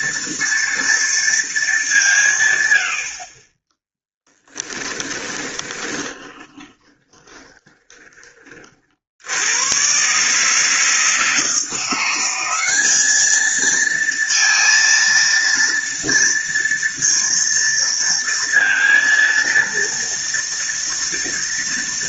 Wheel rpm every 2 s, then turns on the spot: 230, 70, 10, 20, 50, 160, 200, 230, 230, 230, 230.
4-8